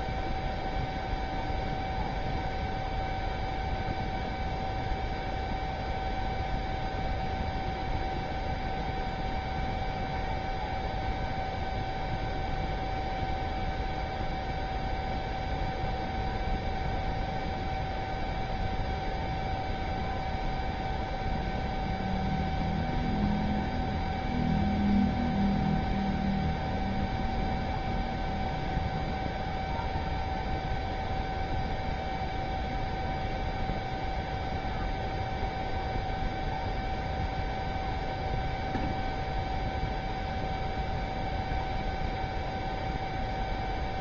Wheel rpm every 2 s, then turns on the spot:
0, 0, 0, 0, 0, 0, 0, 0, 0, 0, 0, 0, 0, 0, 0, 0, 0, 0, 0, 0, 0, 0.
none